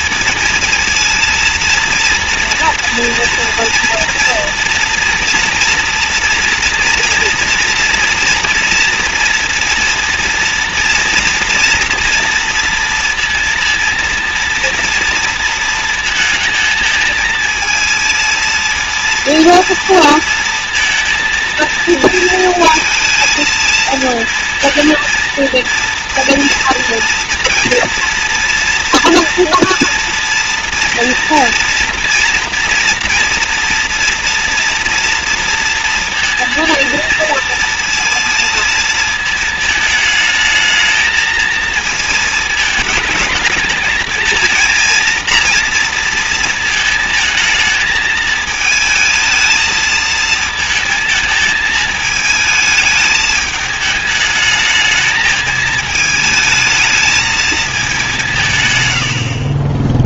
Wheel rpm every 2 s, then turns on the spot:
230, 230, 230, 240, 230, 230, 230, 230, 220, 230, 230, 230, 230, 230, 230, 230, 230, 230, 230, 220, 220, 220, 230, 220, 220, 220, 220, 220, 220, 120.
none